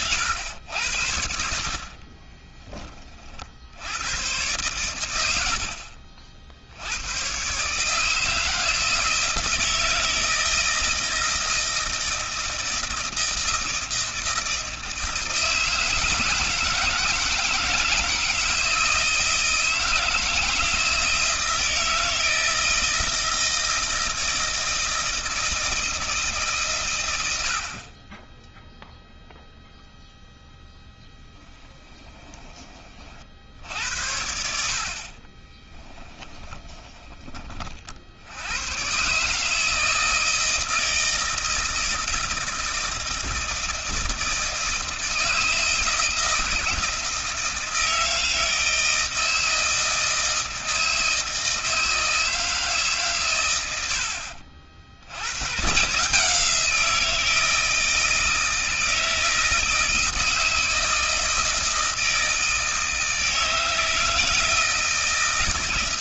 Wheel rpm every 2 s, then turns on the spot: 90, 20, 110, 60, 160, 160, 160, 160, 160, 160, 160, 160, 160, 150, 20, 0, 20, 50, 20, 100, 160, 160, 160, 160, 160, 160, 150, 60, 160, 160, 160, 160, 160.
2-4 36-38